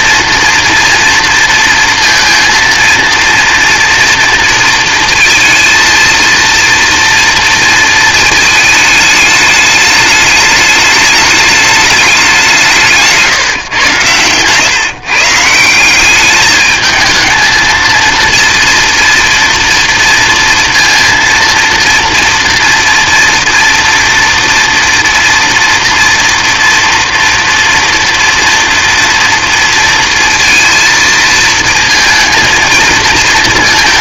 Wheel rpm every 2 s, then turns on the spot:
230, 230, 230, 230, 220, 210, 170, 130, 210, 230, 230, 240, 230, 230, 230, 230, 220.
none